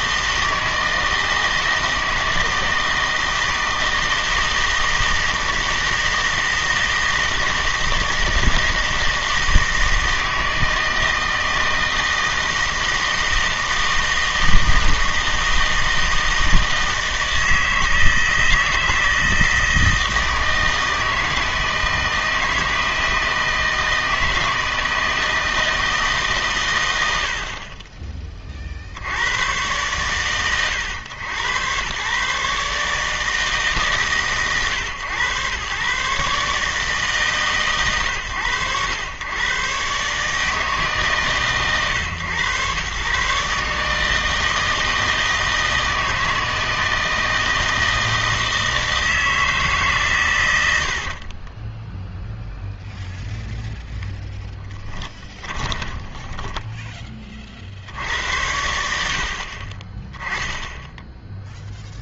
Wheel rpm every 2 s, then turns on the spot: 160, 160, 160, 160, 160, 160, 160, 160, 160, 160, 160, 160, 160, 120, 40, 110, 140, 100, 140, 100, 150, 120, 160, 160, 160, 80, 0, 10, 10, 80, 0.
50-52 56-58